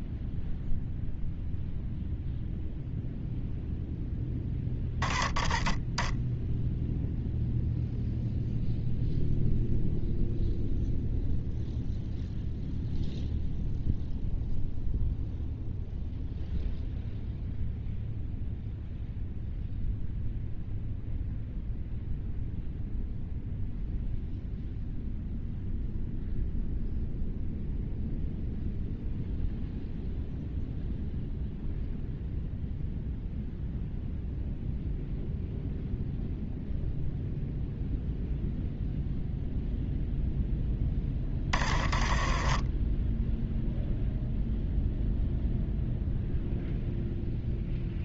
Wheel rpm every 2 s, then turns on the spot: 0, 0, 10, 10, 0, 0, 0, 0, 0, 0, 0, 0, 0, 0, 0, 0, 0, 0, 0, 0, 0, 20, 0, 0.
none